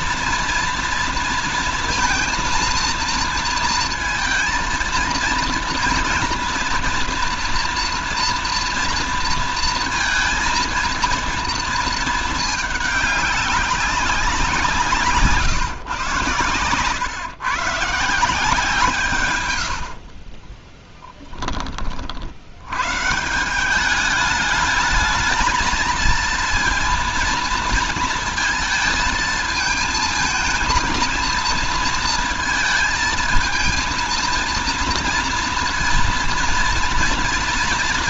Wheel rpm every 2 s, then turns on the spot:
240, 230, 230, 240, 230, 230, 220, 170, 130, 160, 20, 80, 210, 230, 230, 230, 220, 230, 230.
20-22